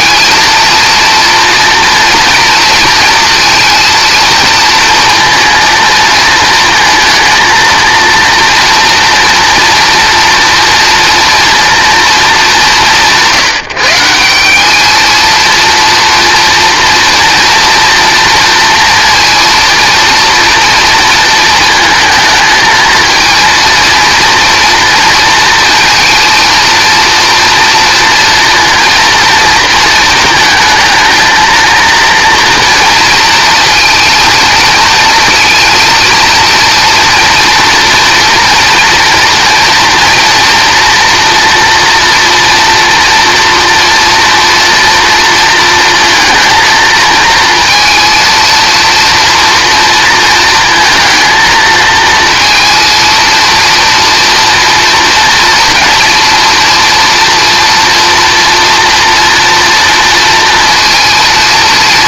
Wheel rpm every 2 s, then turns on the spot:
230, 230, 230, 230, 230, 230, 170, 210, 230, 230, 230, 230, 230, 230, 230, 220, 230, 230, 230, 230, 230, 230, 230, 220, 230, 230, 230, 230, 230, 230, 230.
none